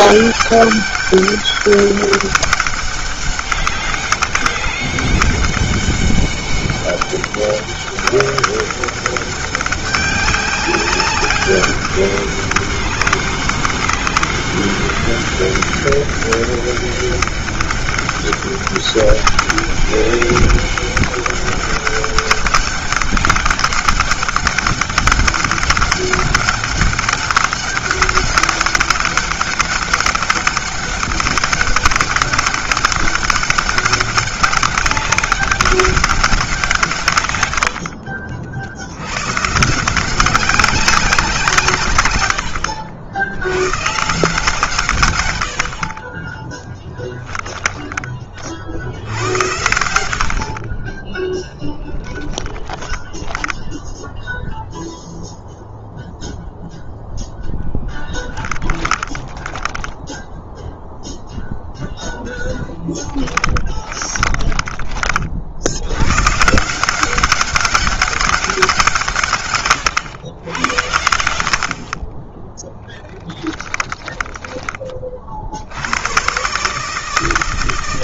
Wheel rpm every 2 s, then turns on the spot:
200, 200, 200, 200, 200, 200, 200, 200, 200, 200, 200, 200, 200, 200, 200, 200, 200, 200, 130, 90, 190, 70, 130, 10, 80, 20, 10, 0, 0, 10, 0, 10, 30, 170, 170, 90, 10, 40, 150.
46-48 52-54 58-60 62-64 72-74